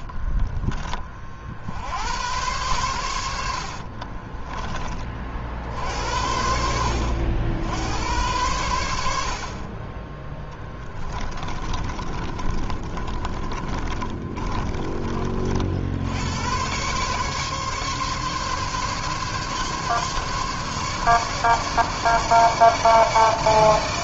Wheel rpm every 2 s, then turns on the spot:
40, 110, 30, 80, 80, 10, 30, 30, 110, 140, 140, 150.
0-2 4-6 10-16